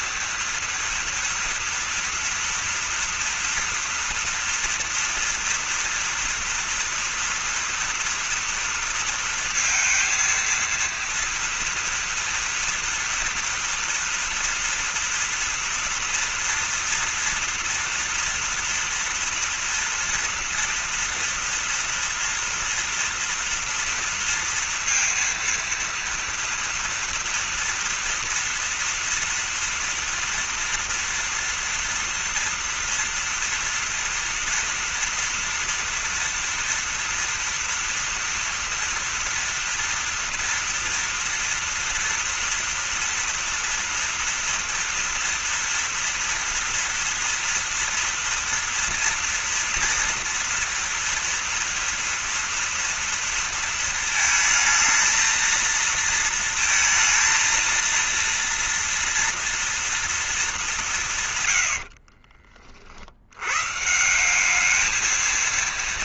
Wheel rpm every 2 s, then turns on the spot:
230, 230, 240, 230, 230, 230, 230, 230, 230, 240, 230, 240, 230, 230, 230, 230, 230, 230, 230, 230, 230, 230, 230, 230, 230, 230, 230, 230, 230, 240, 200, 40, 200.
none